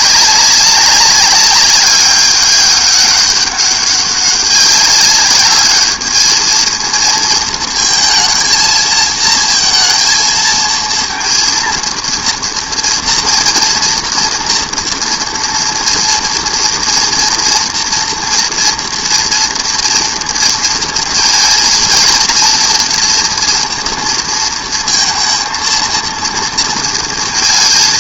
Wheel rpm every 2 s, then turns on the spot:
200, 200, 190, 220, 230, 230, 230, 230, 230, 240, 230, 230, 230, 230.
none